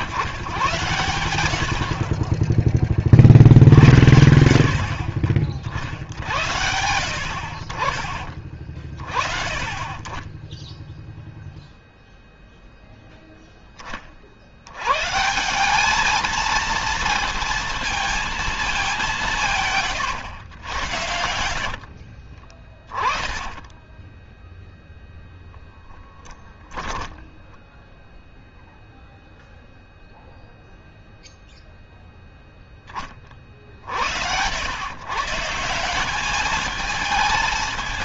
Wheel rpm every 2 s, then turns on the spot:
110, 40, 60, 70, 30, 10, 0, 100, 230, 210, 100, 30, 0, 10, 0, 0, 10, 110, 220.
22-24 26-28